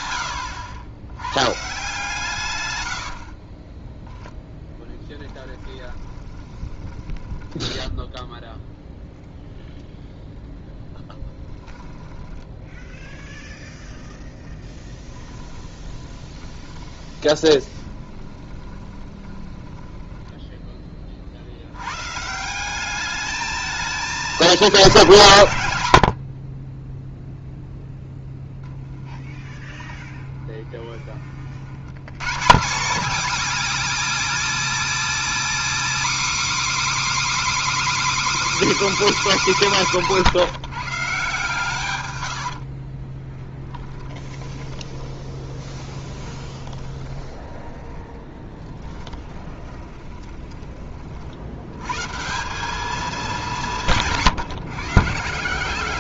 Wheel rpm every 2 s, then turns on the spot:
100, 110, 0, 20, 0, 0, 0, 10, 10, 20, 10, 180, 200, 30, 10, 20, 200, 280, 300, 310, 160, 70, 20, 20, 20, 30, 200, 150.
6-8 14-20 26-30 42-52